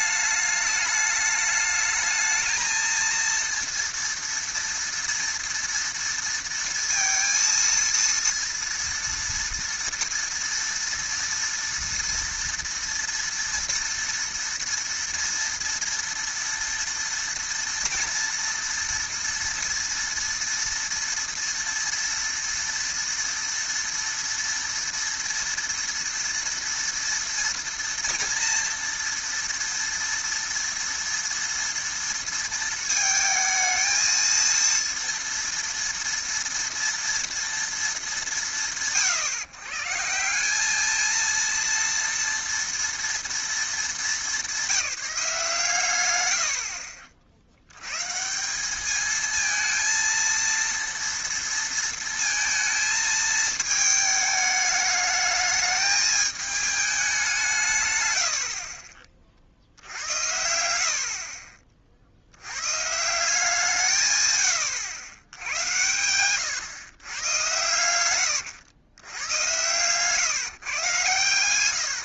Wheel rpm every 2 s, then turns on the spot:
210, 220, 230, 230, 230, 230, 230, 230, 230, 230, 230, 230, 230, 230, 230, 230, 230, 230, 230, 180, 180, 230, 200, 70, 180, 230, 230, 210, 220, 60, 80, 100, 100, 110, 110, 140.
none